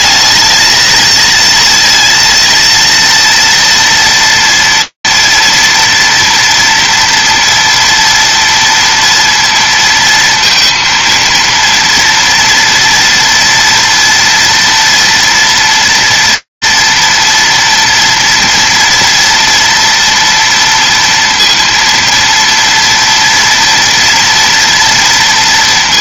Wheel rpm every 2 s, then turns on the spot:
220, 230, 240, 230, 230, 230, 230, 230, 230, 230, 230, 230, 230.
none